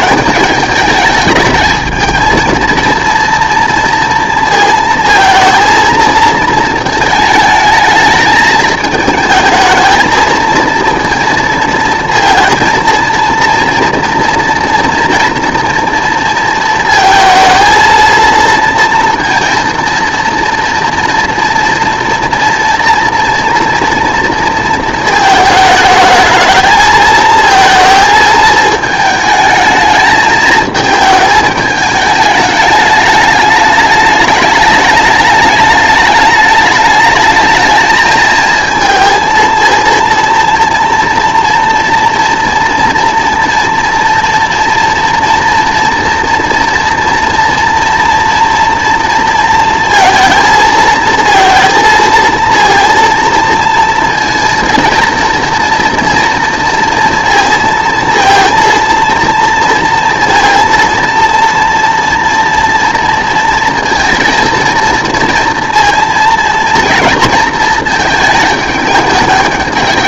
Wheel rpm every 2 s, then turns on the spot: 210, 230, 230, 220, 210, 220, 230, 240, 220, 230, 230, 230, 220, 220, 220, 220, 210, 210, 210, 230, 230, 240, 240, 230, 230, 220, 230, 230, 230, 230, 230, 230, 230, 230, 210.
none